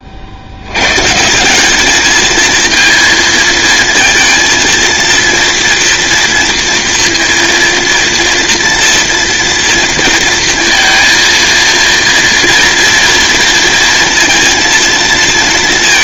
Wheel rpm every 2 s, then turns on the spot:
110, 220, 230, 230, 230, 230, 230, 230.
none